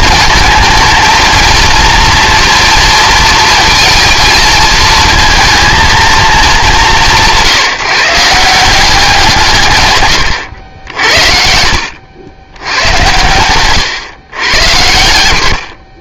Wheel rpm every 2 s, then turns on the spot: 220, 230, 220, 180, 190, 80, 100, 120.
none